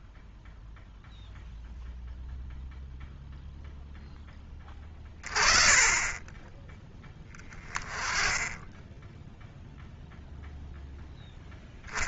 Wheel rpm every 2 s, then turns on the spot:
0, 0, 30, 10, 10, 0.
none